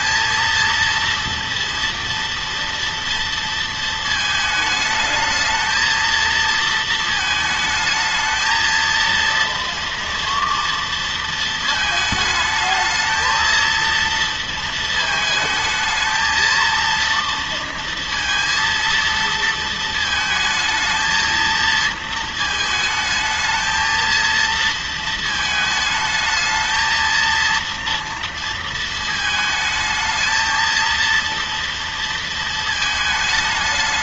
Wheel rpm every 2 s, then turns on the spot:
230, 230, 220, 230, 230, 230, 220, 230, 230, 230, 220, 220, 230, 220, 230, 230, 230.
none